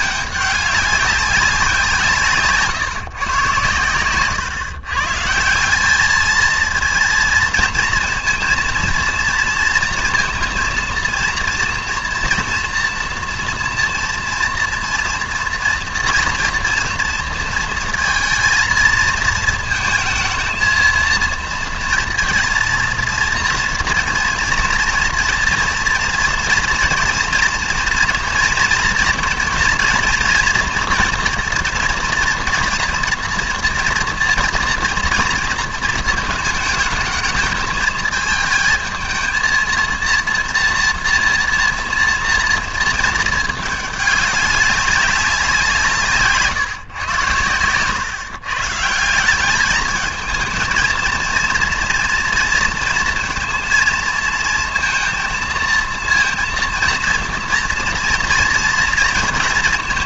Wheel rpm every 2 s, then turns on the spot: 200, 140, 130, 230, 230, 230, 240, 230, 230, 220, 230, 230, 230, 230, 230, 240, 230, 230, 220, 220, 230, 230, 200, 140, 150, 230, 230, 230, 230, 230.
none